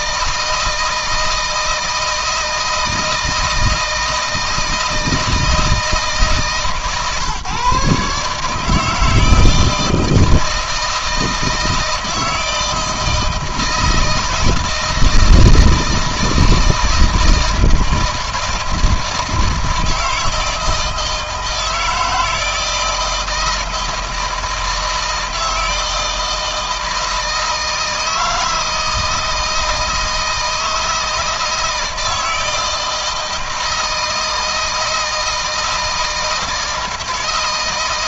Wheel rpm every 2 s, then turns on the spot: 160, 160, 160, 150, 150, 160, 160, 170, 160, 160, 160, 160, 160, 160, 160, 160, 160, 160, 160.
none